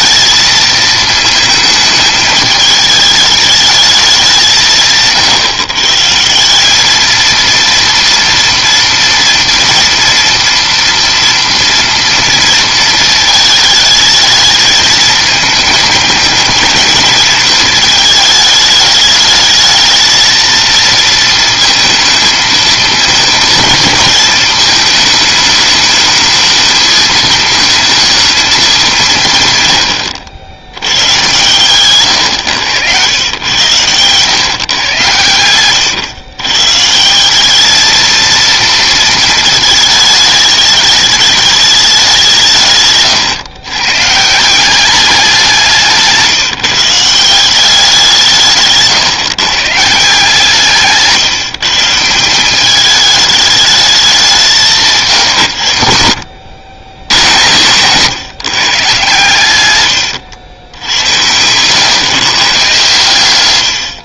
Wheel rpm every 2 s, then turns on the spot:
220, 210, 170, 180, 230, 230, 230, 220, 220, 210, 230, 220, 220, 220, 220, 90, 100, 130, 130, 230, 210, 160, 170, 160, 150, 160, 200, 180, 80, 140, 90, 130.
none